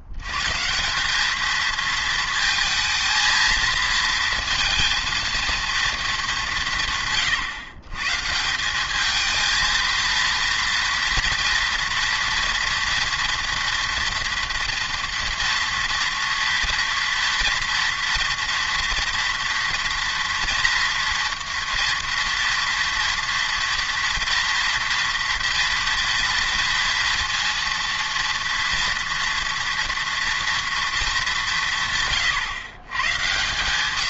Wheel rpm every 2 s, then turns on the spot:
150, 220, 230, 160, 190, 230, 230, 230, 240, 230, 230, 230, 230, 230, 240, 230, 130.
none